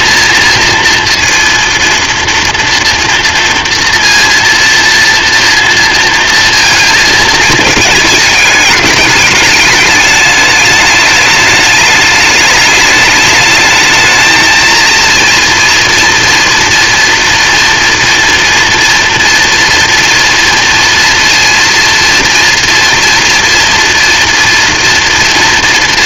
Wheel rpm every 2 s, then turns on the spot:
230, 230, 230, 230, 210, 210, 220, 220, 230, 230, 230, 230, 230.
none